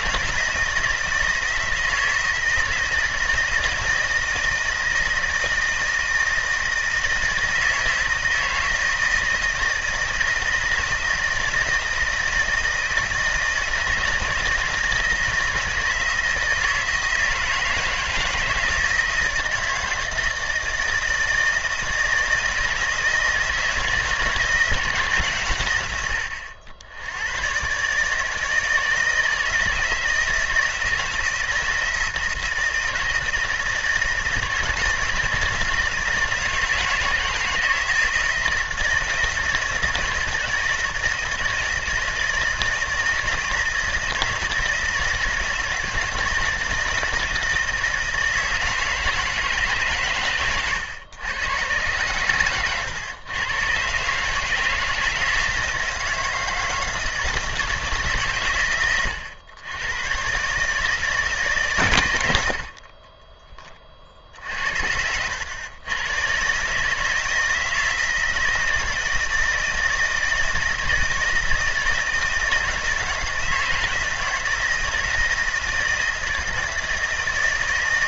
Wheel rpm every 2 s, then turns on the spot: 160, 160, 160, 160, 160, 160, 160, 160, 160, 160, 160, 160, 160, 80, 160, 160, 160, 160, 160, 170, 160, 160, 160, 160, 160, 110, 120, 160, 160, 110, 150, 30, 80, 150, 160, 160, 160, 160, 160.
none